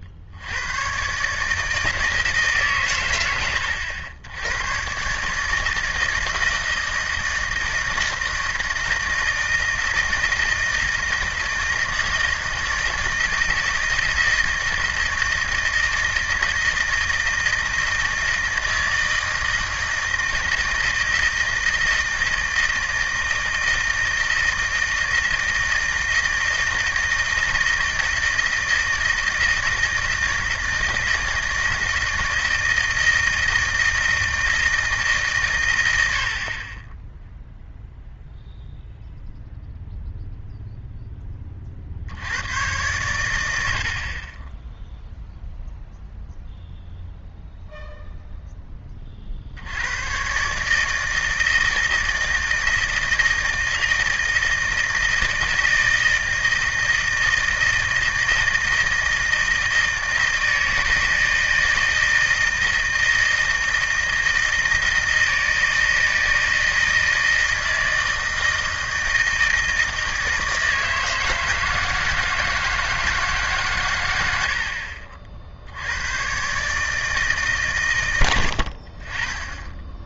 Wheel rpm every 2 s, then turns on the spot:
90, 140, 100, 160, 160, 160, 160, 160, 160, 160, 160, 160, 160, 160, 160, 160, 160, 160, 30, 0, 0, 110, 10, 0, 10, 140, 160, 160, 160, 160, 160, 160, 160, 160, 160, 160, 160, 70, 140, 70.
none